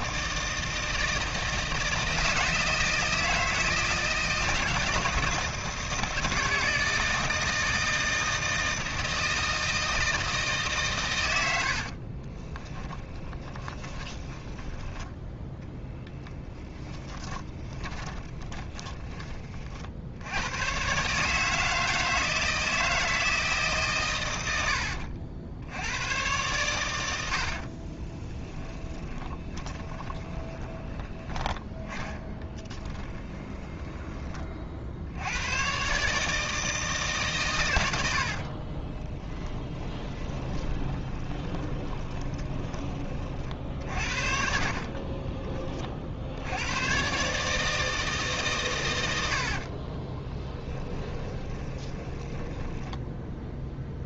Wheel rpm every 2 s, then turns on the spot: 160, 160, 160, 160, 160, 130, 20, 10, 10, 20, 130, 160, 70, 90, 10, 10, 10, 60, 150, 20, 20, 20, 30, 110, 120, 20, 10.
12-14 16-18 28-30 32-34 38-42 44-46 50-54